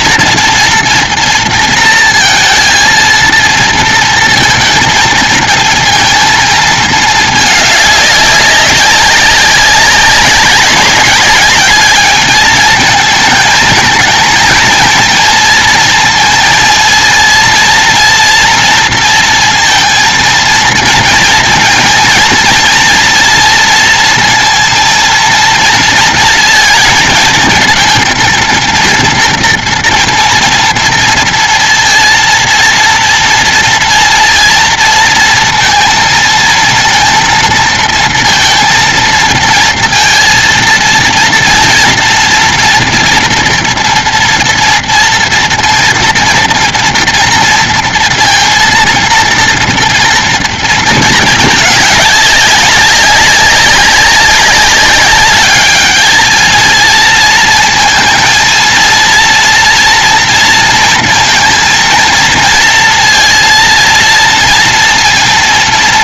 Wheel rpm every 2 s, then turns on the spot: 230, 230, 230, 230, 200, 190, 210, 220, 230, 240, 230, 230, 230, 230, 230, 230, 230, 230, 230, 230, 230, 230, 230, 230, 230, 230, 210, 190, 220, 220, 230, 230, 230.
none